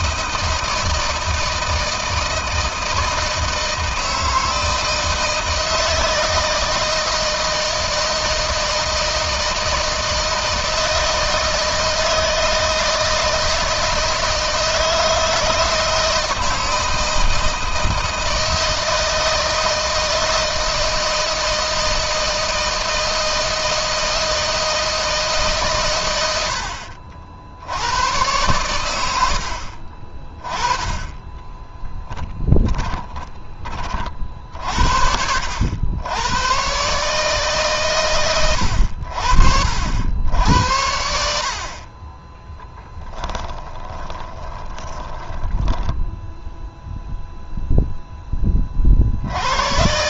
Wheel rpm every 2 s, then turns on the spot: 160, 160, 160, 160, 160, 160, 160, 160, 160, 160, 160, 160, 160, 90, 100, 20, 10, 60, 140, 90, 80, 10, 20, 0, 50.
32-34 44-46